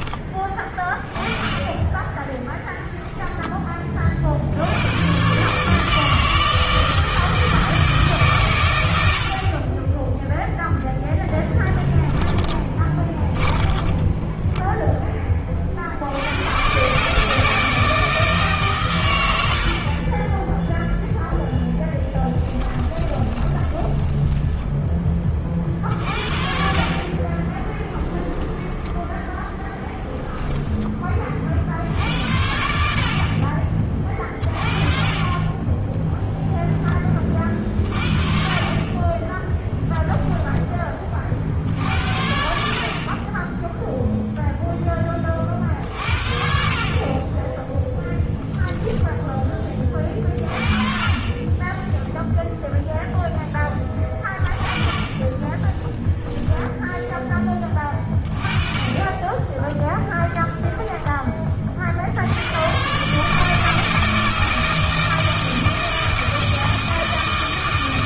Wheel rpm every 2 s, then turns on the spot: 20, 0, 90, 160, 100, 0, 20, 10, 130, 130, 0, 20, 10, 50, 10, 10, 60, 30, 10, 40, 10, 50, 10, 50, 10, 40, 0, 30, 10, 30, 20, 120, 160, 160.
12-14 22-24 28-30 56-58 60-62